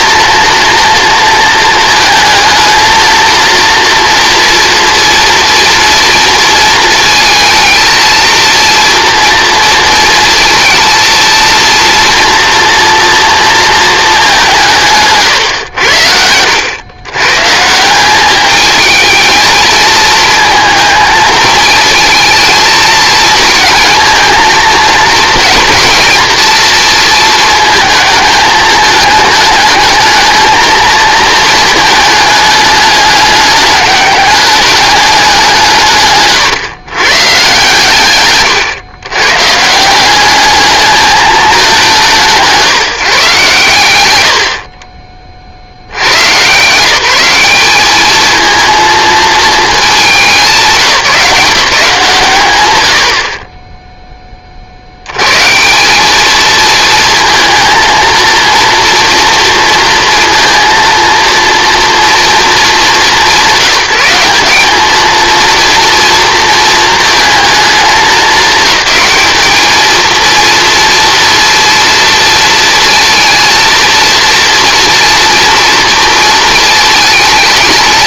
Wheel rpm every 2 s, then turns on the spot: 230, 230, 230, 230, 230, 220, 230, 170, 100, 210, 230, 230, 230, 230, 220, 220, 210, 210, 130, 130, 210, 150, 100, 140, 220, 180, 100, 40, 220, 230, 230, 220, 200, 220, 210, 230, 230, 230, 220.
none